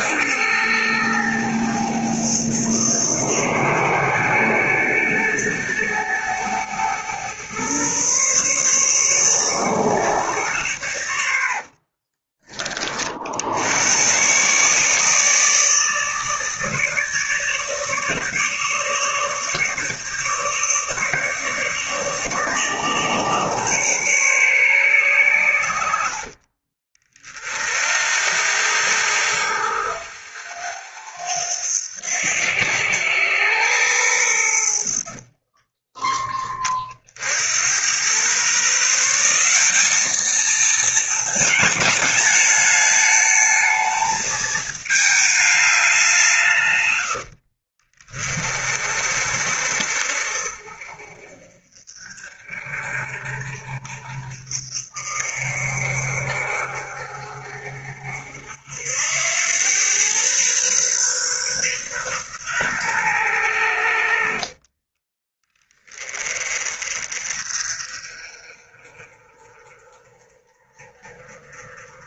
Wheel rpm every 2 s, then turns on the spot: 110, 110, 110, 110, 140, 100, 50, 150, 150, 150, 150, 150, 120, 40, 90, 90, 100, 50, 40, 160, 220, 210, 220, 120, 40, 50, 50, 50, 50, 80, 130, 110, 30, 40, 40, 40.
34-36